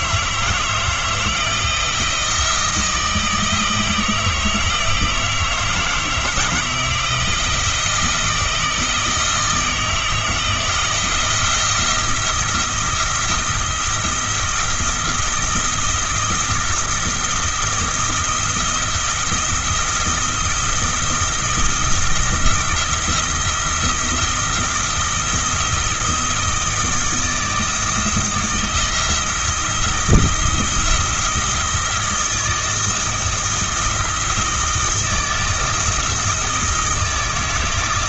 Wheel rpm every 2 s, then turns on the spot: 160, 170, 160, 160, 170, 170, 170, 170, 170, 160, 170, 170, 170, 160, 170, 170, 170, 170, 160.
none